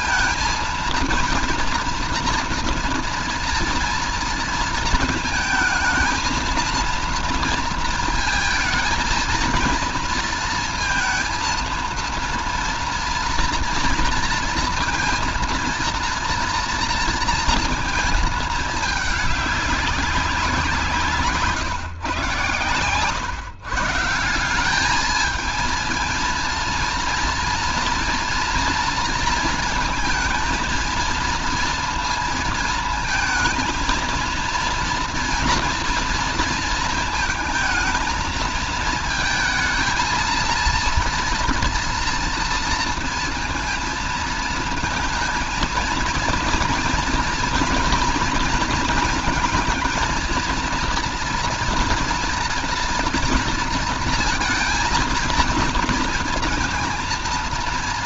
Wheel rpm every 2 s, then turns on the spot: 230, 240, 230, 230, 220, 230, 230, 230, 230, 220, 180, 120, 180, 230, 230, 230, 230, 230, 220, 220, 230, 230, 220, 230, 230, 230, 230, 230, 220.
none